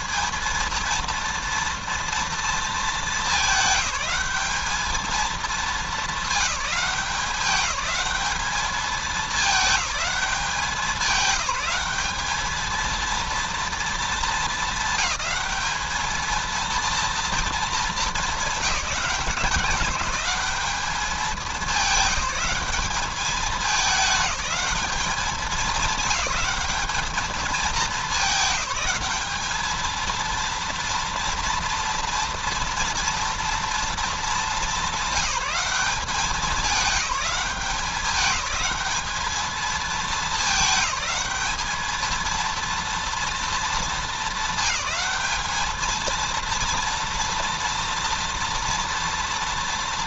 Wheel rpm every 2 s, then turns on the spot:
220, 230, 220, 210, 210, 200, 210, 210, 220, 190, 200, 200, 210, 200, 200, 230, 230, 220, 200, 200, 220, 230, 220, 230, 230.
none